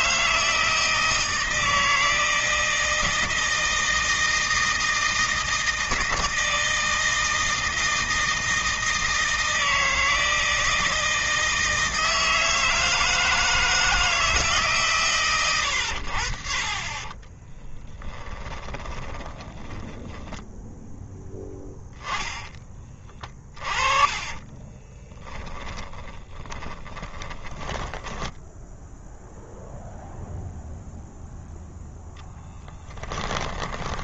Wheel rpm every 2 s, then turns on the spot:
160, 160, 160, 160, 160, 160, 160, 130, 20, 10, 10, 40, 20, 10, 0, 0, 10.
16-28 32-34